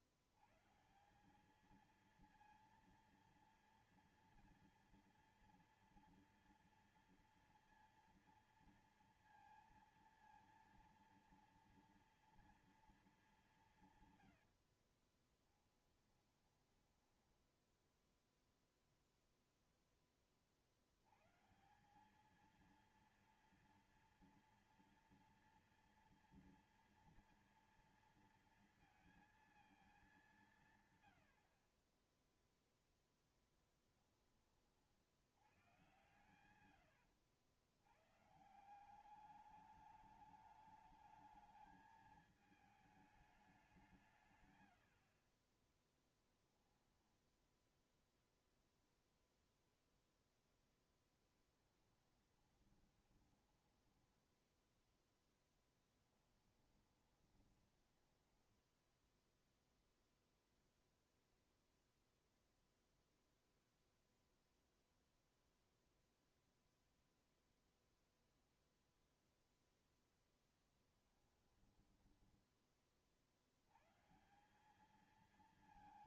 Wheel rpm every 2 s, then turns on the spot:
110, 230, 230, 230, 230, 230, 230, 100, 10, 0, 40, 200, 230, 240, 230, 200, 20, 20, 110, 140, 210, 210, 150, 10, 0, 0, 10, 10, 10, 10, 0, 0, 0, 0, 0, 0, 10, 160.
14-18 46-48 52-54 56-60